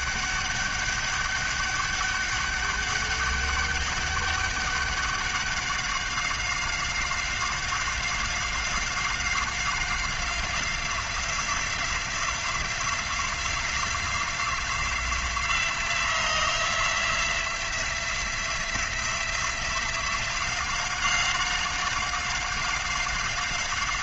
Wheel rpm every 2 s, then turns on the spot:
200, 200, 200, 190, 190, 180, 180, 180, 180, 170, 180, 190.
none